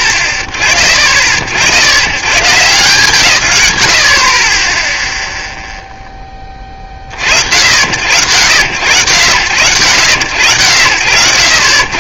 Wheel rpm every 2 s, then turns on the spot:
40, 150, 30, 20, 80, 70.
none